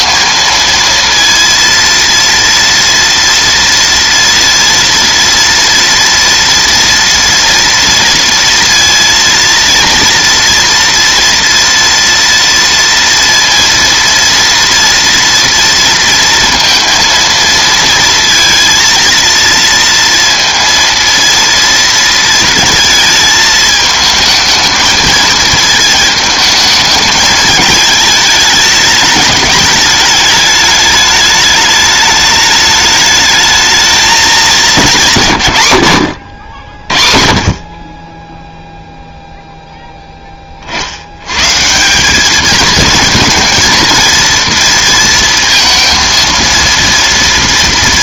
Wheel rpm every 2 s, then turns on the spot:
230, 230, 230, 230, 230, 230, 230, 230, 230, 230, 230, 230, 220, 210, 210, 210, 210, 210, 70, 0, 40, 210, 230, 230.
none